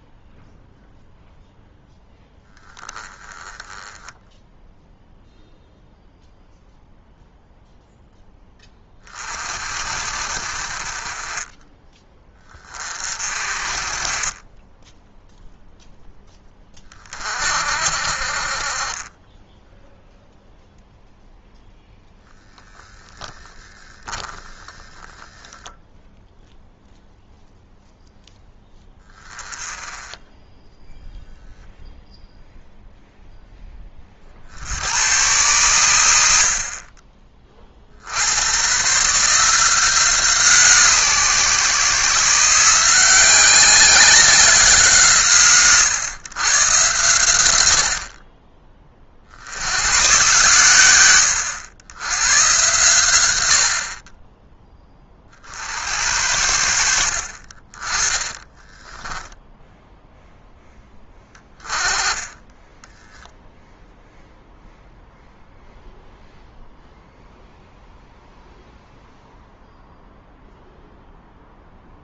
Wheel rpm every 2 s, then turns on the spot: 0, 10, 0, 0, 20, 30, 30, 10, 30, 30, 0, 0, 10, 0, 10, 0, 0, 80, 40, 130, 150, 170, 170, 120, 40, 110, 110, 20, 70, 10, 10, 10, 0, 0, 0, 0.
56-60 62-64